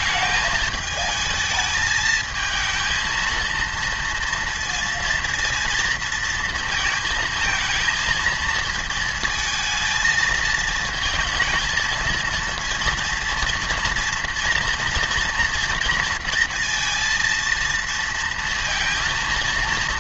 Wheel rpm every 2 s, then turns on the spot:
220, 220, 230, 220, 220, 220, 230, 230, 230, 230.
none